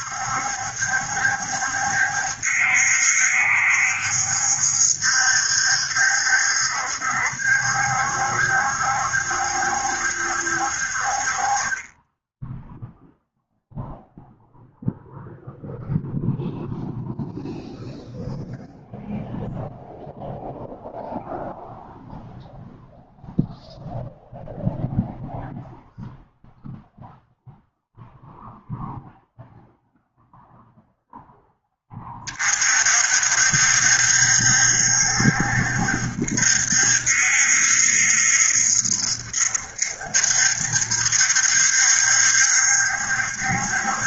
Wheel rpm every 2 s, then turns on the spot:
70, 70, 70, 70, 70, 50, 0, 0, 0, 0, 0, 0, 0, 0, 0, 0, 50, 70, 70, 70, 70, 70.
none